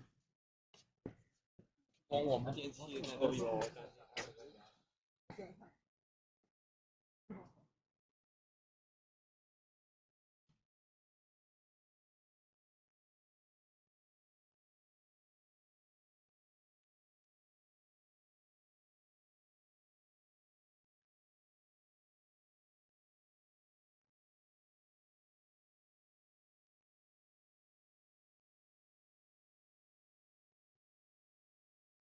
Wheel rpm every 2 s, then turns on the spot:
0, 0, 0, 0, 0, 0, 0, 0, 0, 0, 0, 0, 0, 0, 0, 0.
none